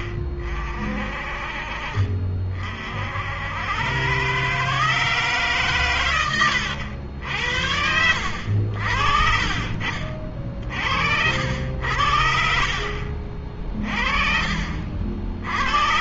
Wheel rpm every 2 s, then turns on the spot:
50, 50, 120, 90, 70, 70, 50, 40.
none